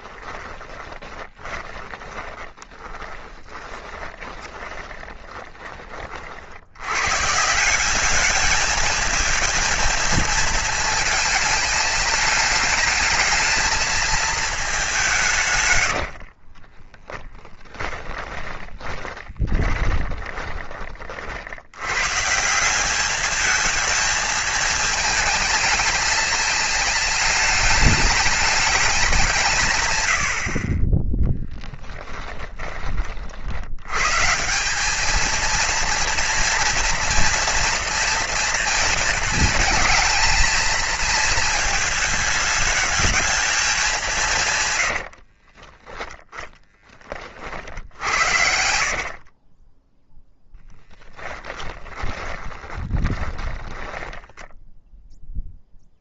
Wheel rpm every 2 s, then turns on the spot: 10, 20, 20, 100, 220, 220, 210, 200, 20, 20, 30, 190, 220, 210, 200, 20, 30, 190, 230, 230, 220, 220, 100, 20, 50, 10, 20, 0.
0-6 16-20 44-46 48-54